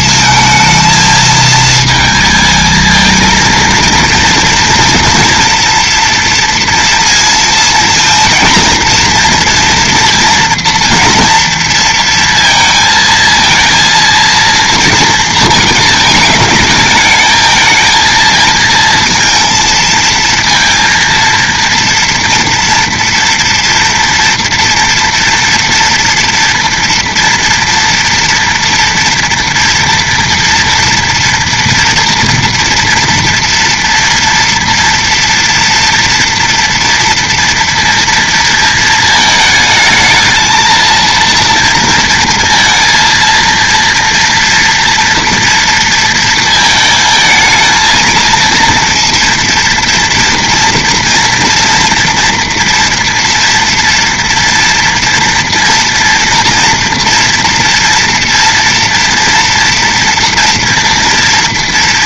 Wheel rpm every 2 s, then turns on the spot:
230, 220, 230, 230, 230, 230, 230, 230, 220, 230, 230, 230, 230, 240, 230, 230, 230, 230, 230, 230, 230, 230, 230, 220, 230, 230, 230, 230, 240, 230, 240.
none